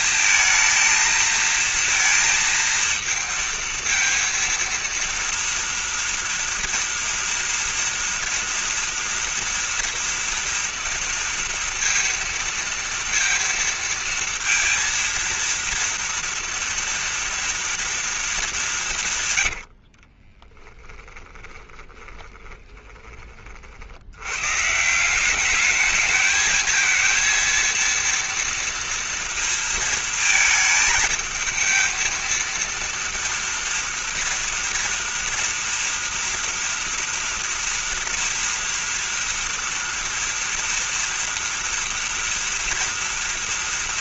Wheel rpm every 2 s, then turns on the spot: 230, 230, 230, 230, 230, 230, 230, 230, 230, 170, 10, 30, 160, 220, 230, 220, 230, 230, 230, 230, 230, 230.
20-24